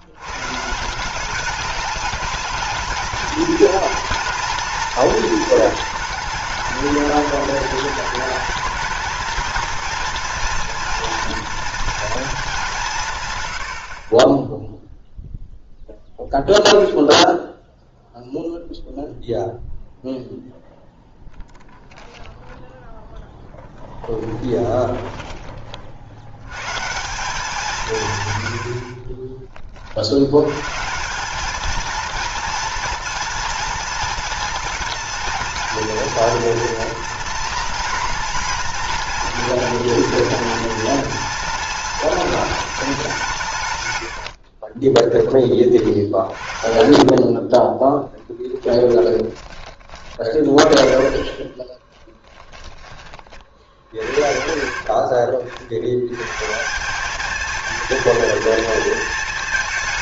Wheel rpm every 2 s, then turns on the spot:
150, 220, 230, 210, 220, 230, 170, 0, 0, 0, 0, 10, 10, 140, 70, 130, 230, 230, 230, 230, 230, 210, 30, 40, 20, 40, 30, 40, 180, 230.
44-50 52-54